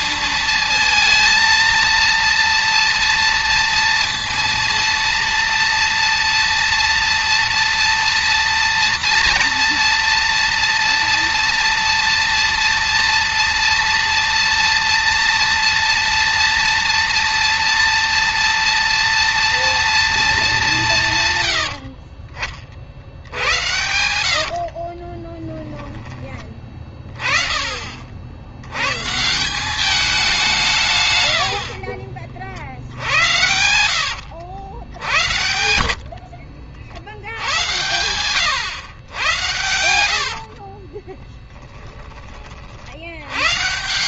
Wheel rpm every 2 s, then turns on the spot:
230, 230, 230, 230, 230, 230, 230, 230, 230, 230, 150, 60, 40, 20, 120, 110, 70, 80, 90, 120, 30, 70.
24-26 30-34 40-42